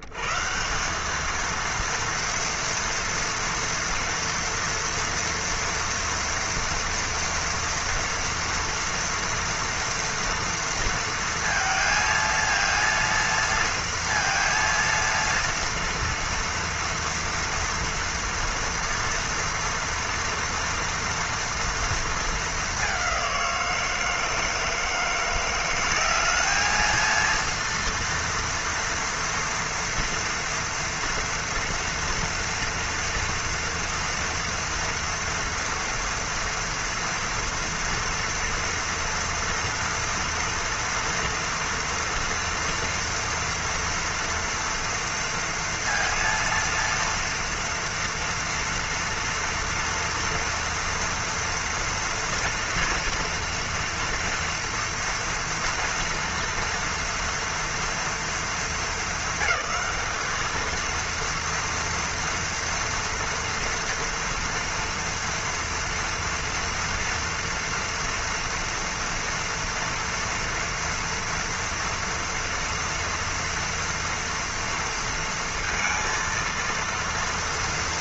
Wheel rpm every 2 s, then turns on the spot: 120, 230, 230, 230, 230, 230, 230, 230, 230, 230, 230, 210, 160, 210, 230, 230, 230, 230, 230, 230, 230, 230, 240, 230, 240, 240, 230, 230, 230, 220, 210, 230, 230, 230, 230, 230, 230, 230, 230.
none